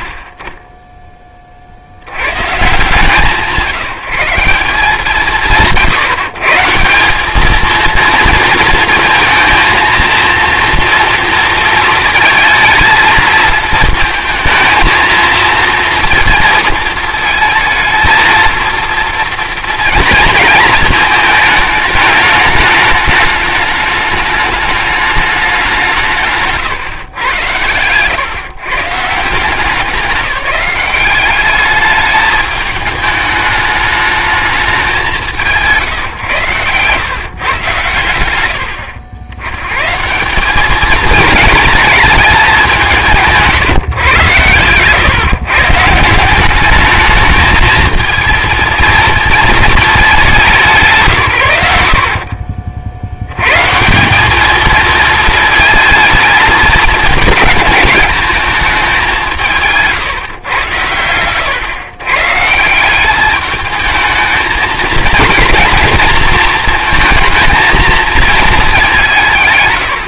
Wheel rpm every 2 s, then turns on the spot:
40, 130, 150, 170, 230, 230, 220, 230, 230, 230, 220, 210, 210, 140, 140, 190, 210, 200, 130, 100, 200, 200, 120, 200, 230, 140, 60, 220, 220, 210, 130, 160, 220, 220, 210.
26-28